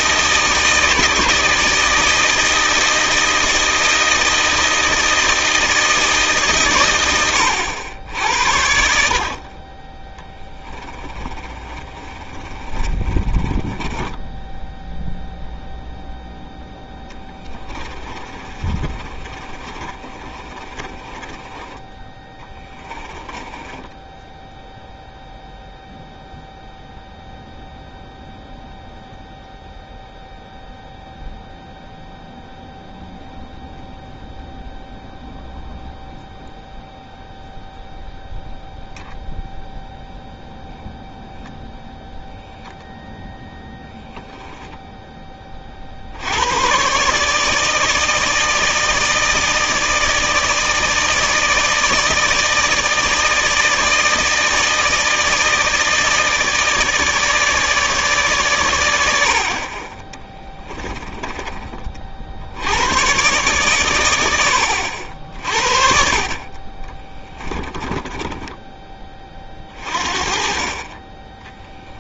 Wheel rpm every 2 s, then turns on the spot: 160, 160, 160, 110, 70, 20, 30, 0, 10, 30, 30, 20, 0, 0, 0, 0, 0, 0, 0, 0, 0, 0, 10, 130, 160, 160, 160, 160, 150, 100, 10, 100, 60, 30, 20, 30.
10-14 16-24 60-62